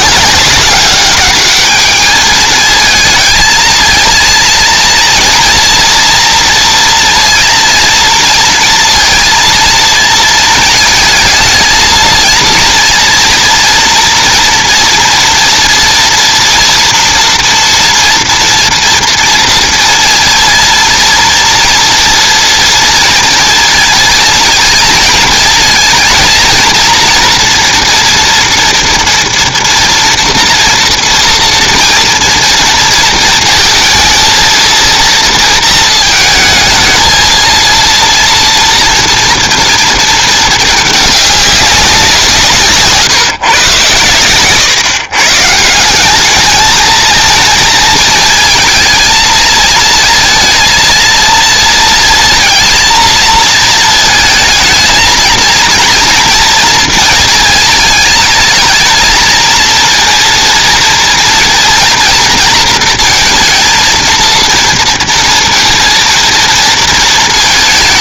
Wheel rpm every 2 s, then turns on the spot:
200, 220, 230, 230, 230, 230, 230, 230, 240, 240, 230, 230, 220, 230, 230, 230, 230, 230, 220, 240, 210, 150, 130, 220, 220, 220, 220, 220, 230, 220, 230, 230, 230, 230.
none